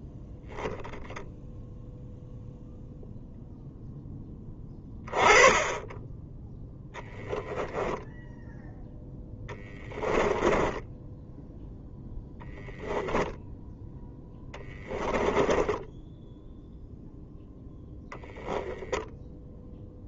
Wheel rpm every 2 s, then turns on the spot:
0, 0, 10, 10, 0, 20, 0, 10, 0, 0.
10-12 14-16